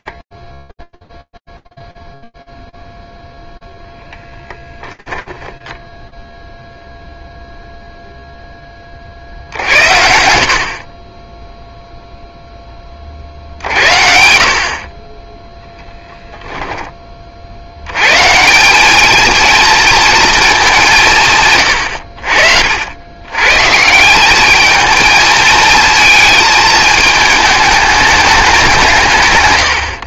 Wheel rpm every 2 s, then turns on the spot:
60, 0, 10, 0, 40, 30, 40, 30, 30, 210, 160, 90, 220, 220, 140.
4-6